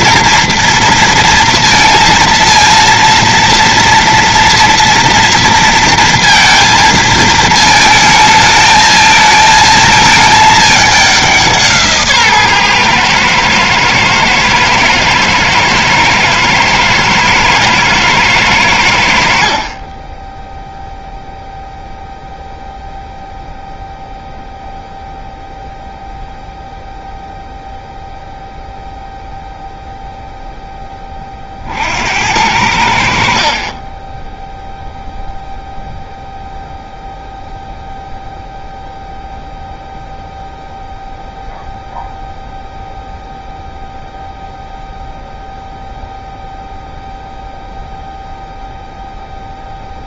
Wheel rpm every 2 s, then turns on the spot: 230, 230, 240, 230, 220, 210, 130, 110, 110, 90, 0, 0, 0, 0, 0, 10, 80, 0, 0, 0, 0, 0, 0, 0, 0.
none